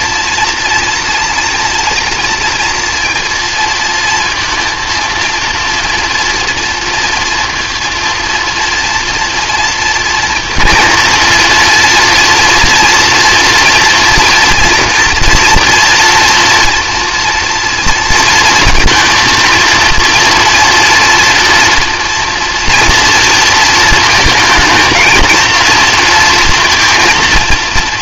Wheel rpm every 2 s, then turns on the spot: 230, 230, 230, 230, 230, 230, 240, 230, 240, 230, 240, 230, 230, 230.
none